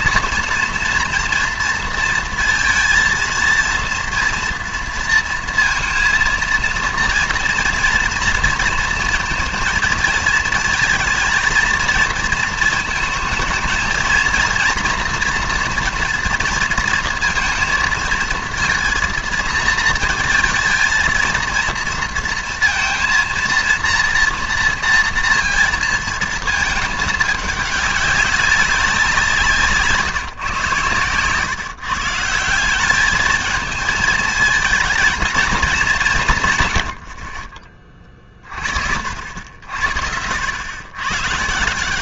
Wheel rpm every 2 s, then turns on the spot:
230, 230, 230, 230, 230, 230, 220, 230, 230, 230, 230, 230, 230, 220, 190, 130, 180, 220, 120, 50, 100.
none